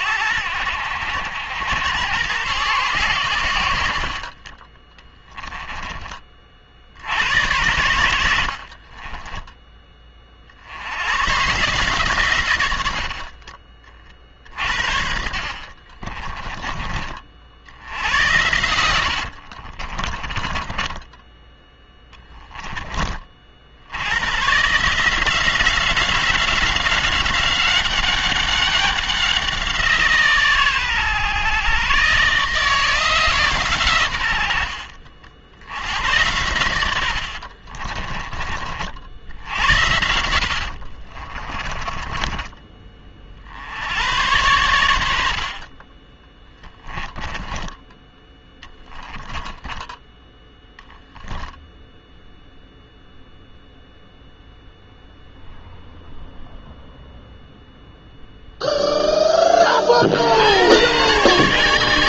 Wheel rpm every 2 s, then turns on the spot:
70, 110, 20, 70, 30, 90, 90, 50, 30, 90, 20, 30, 160, 190, 190, 130, 160, 60, 90, 60, 50, 30, 90, 10, 10, 0, 0, 0, 0, 0, 110.
4-6 8-10 18-22 36-38 40-42 46-50